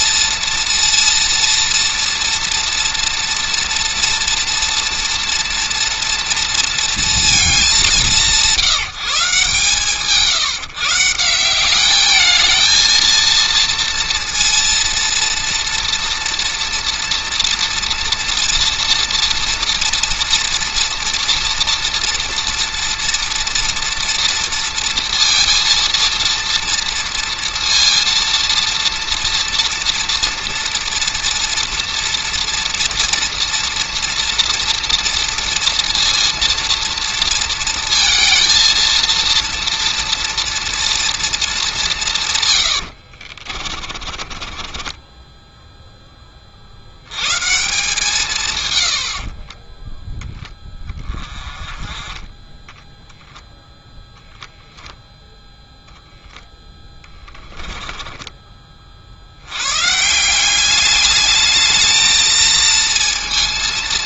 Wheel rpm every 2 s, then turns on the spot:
230, 230, 230, 230, 170, 160, 230, 230, 230, 230, 230, 230, 230, 230, 230, 230, 230, 230, 230, 230, 240, 80, 10, 70, 100, 20, 0, 0, 10, 50, 200, 230.
42-46 56-58